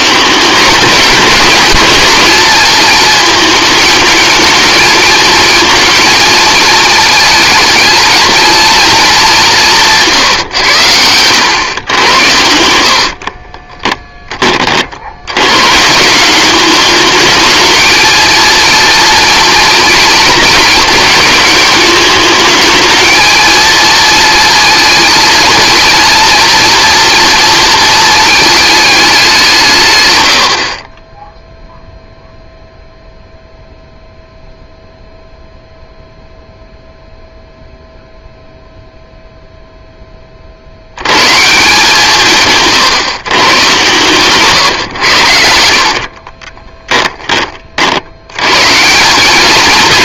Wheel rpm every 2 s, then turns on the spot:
200, 230, 220, 230, 220, 90, 80, 50, 210, 230, 210, 220, 230, 230, 210, 40, 0, 0, 0, 0, 50, 110, 120, 20, 150.
12-14 46-48